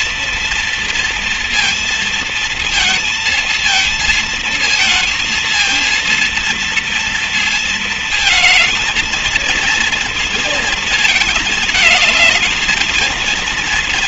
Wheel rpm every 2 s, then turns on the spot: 230, 230, 220, 230, 220, 230, 220.
none